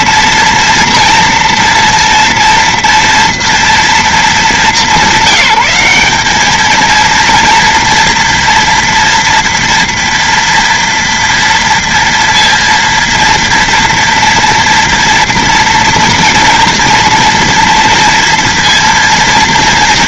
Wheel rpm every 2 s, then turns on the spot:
230, 240, 230, 190, 240, 230, 230, 230, 230, 230.
none